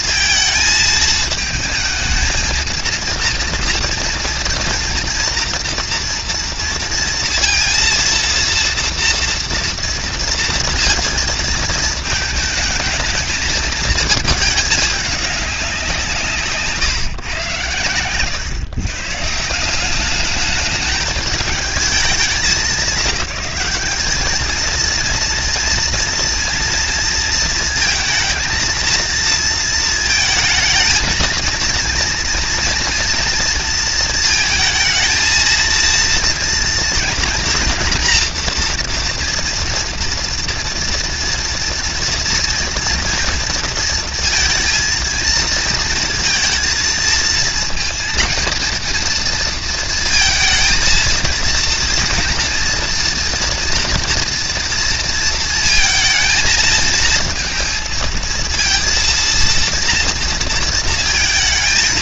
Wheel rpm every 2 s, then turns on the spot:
220, 230, 230, 230, 230, 230, 220, 210, 130, 130, 220, 190, 220, 230, 220, 220, 230, 220, 230, 230, 230, 230, 230, 230, 230, 230, 240, 230, 230, 230, 230.
none